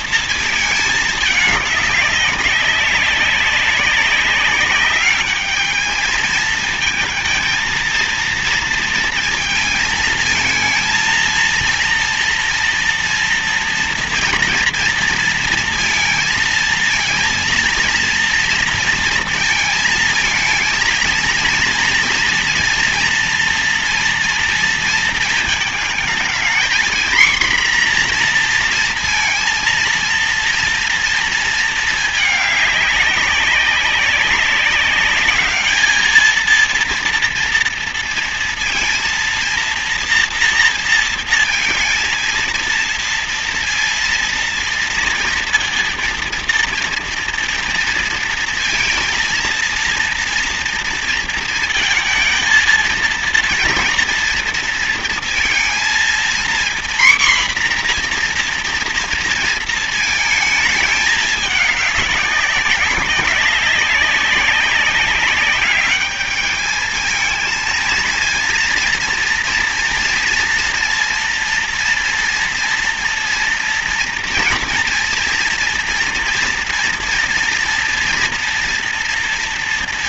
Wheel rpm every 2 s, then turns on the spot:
220, 200, 190, 220, 230, 230, 230, 230, 230, 230, 220, 230, 230, 220, 240, 230, 210, 200, 220, 230, 230, 230, 230, 230, 230, 230, 230, 230, 240, 240, 220, 200, 190, 210, 230, 230, 230, 230, 230, 240.
none